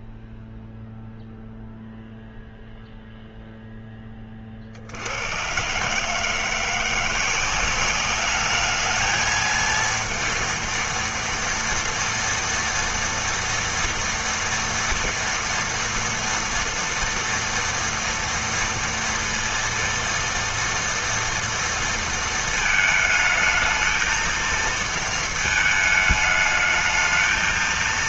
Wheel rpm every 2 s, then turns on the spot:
0, 0, 40, 160, 210, 230, 230, 230, 230, 230, 230, 220, 220, 220.
none